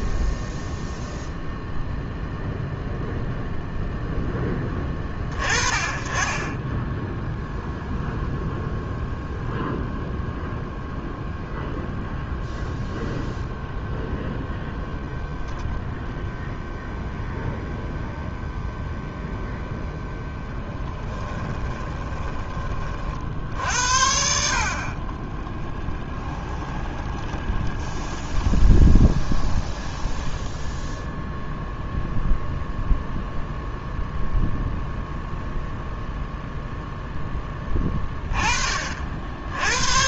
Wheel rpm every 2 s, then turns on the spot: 0, 0, 20, 10, 0, 0, 0, 0, 0, 0, 10, 40, 40, 20, 20, 10, 0, 0, 0, 50.
20-22 26-30